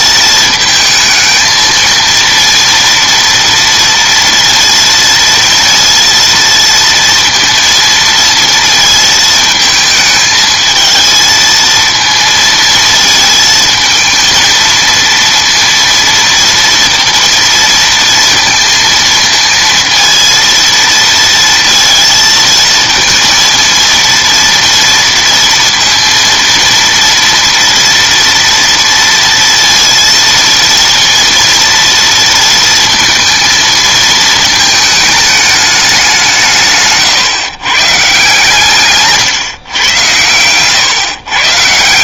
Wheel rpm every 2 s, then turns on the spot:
220, 230, 230, 230, 230, 220, 220, 230, 230, 230, 230, 230, 230, 230, 230, 230, 230, 210, 130, 150, 130.
36-38